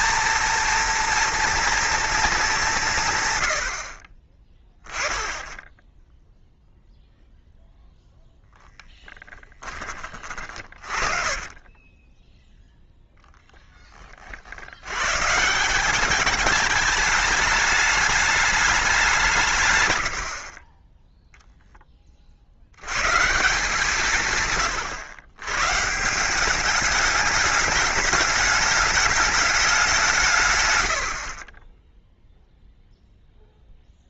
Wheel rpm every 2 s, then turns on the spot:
230, 210, 20, 0, 0, 30, 0, 70, 210, 200, 30, 70, 130, 190, 210, 110, 0.
10-12